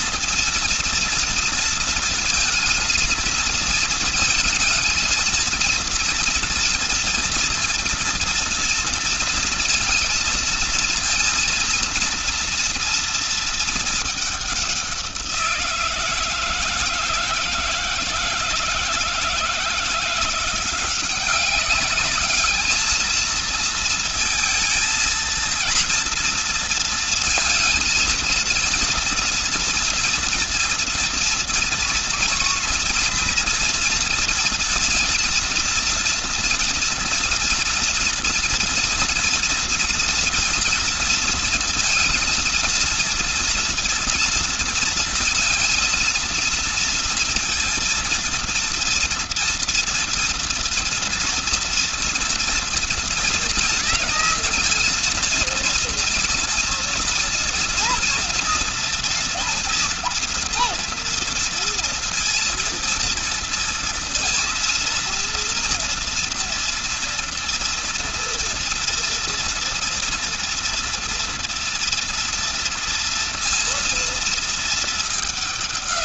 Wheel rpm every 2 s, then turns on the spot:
230, 230, 230, 240, 230, 230, 230, 210, 160, 160, 170, 210, 230, 230, 230, 240, 230, 230, 230, 230, 230, 230, 230, 230, 230, 230, 230, 230, 230, 230, 240, 230, 230, 230, 240, 230, 230, 230.
none